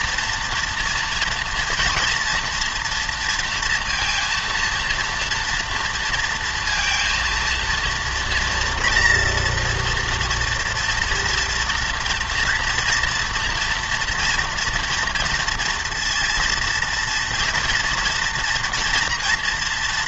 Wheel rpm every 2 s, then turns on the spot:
230, 230, 230, 230, 230, 230, 230, 230, 230, 230.
none